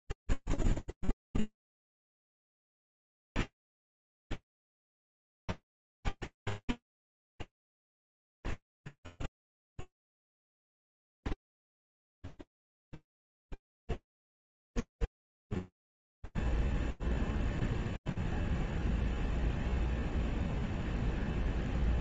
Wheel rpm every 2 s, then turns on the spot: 10, 0, 0, 0, 0, 0, 0, 0, 0, 0, 0.
none